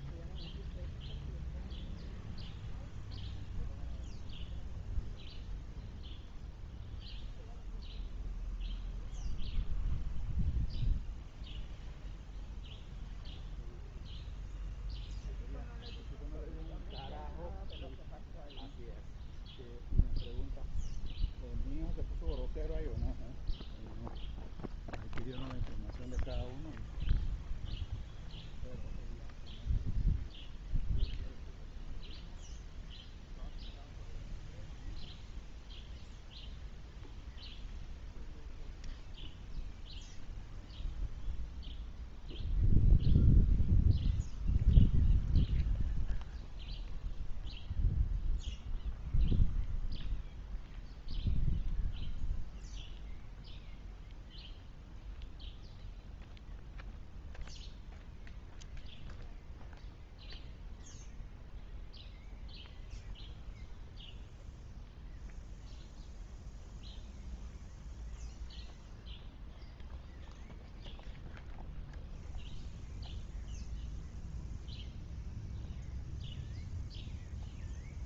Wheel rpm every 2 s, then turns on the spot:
0, 0, 0, 0, 0, 0, 0, 0, 0, 0, 0, 0, 0, 0, 0, 0, 0, 0, 0, 0, 0, 0, 0, 0, 0, 0, 0, 0, 0, 0, 0, 0, 0, 0, 0, 0, 0, 0, 0.
none